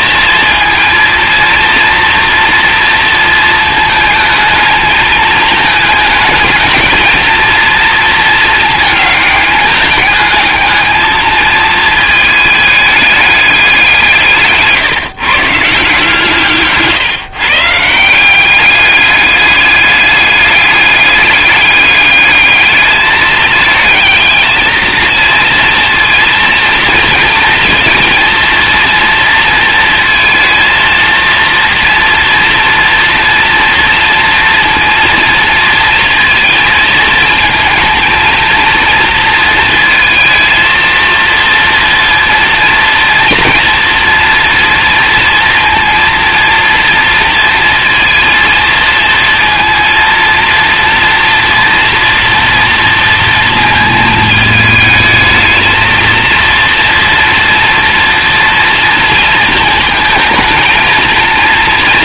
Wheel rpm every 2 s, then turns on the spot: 230, 230, 220, 220, 220, 220, 210, 140, 140, 200, 200, 220, 230, 230, 230, 230, 230, 230, 230, 230, 230, 230, 230, 230, 230, 230, 230, 220, 230, 230, 230.
none